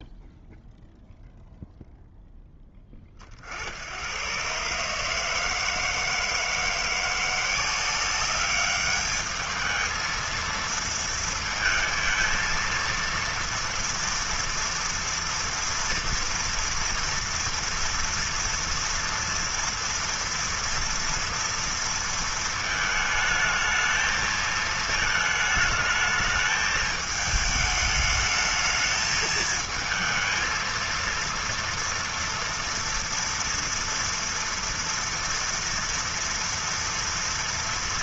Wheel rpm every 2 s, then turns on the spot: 0, 20, 150, 170, 210, 230, 230, 230, 230, 230, 230, 220, 220, 220, 220, 230, 230, 230, 230.
none